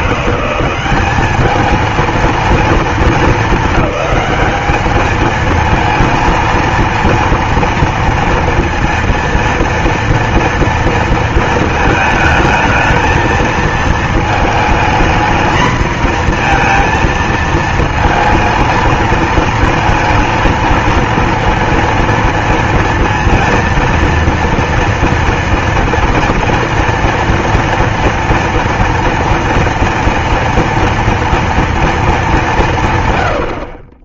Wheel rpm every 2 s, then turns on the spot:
190, 230, 210, 230, 230, 230, 220, 220, 230, 230, 230, 230, 230, 230, 230, 230, 170.
none